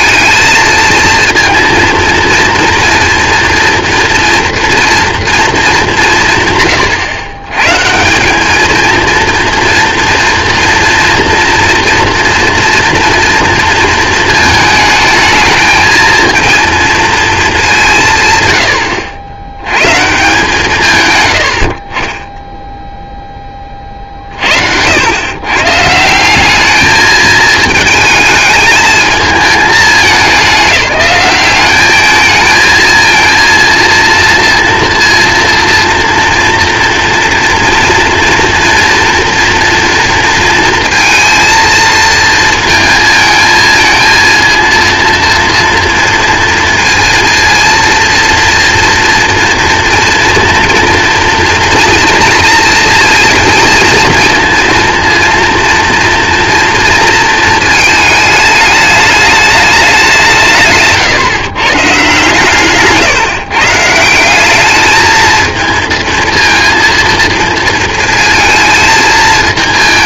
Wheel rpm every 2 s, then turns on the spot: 230, 230, 230, 160, 220, 230, 230, 220, 230, 100, 140, 0, 70, 200, 220, 200, 220, 230, 240, 240, 230, 230, 230, 230, 230, 230, 230, 230, 230, 210, 150, 140, 200, 230, 220.
none